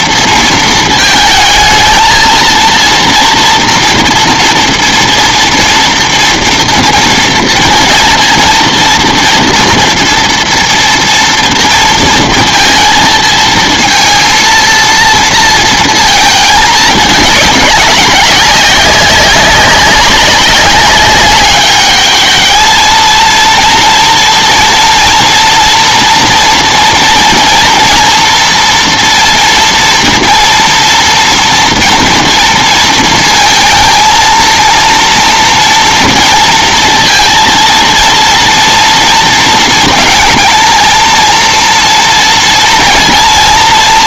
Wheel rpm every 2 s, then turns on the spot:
230, 230, 240, 230, 230, 230, 220, 230, 210, 190, 200, 220, 230, 230, 230, 230, 230, 230, 230, 230, 220, 230.
none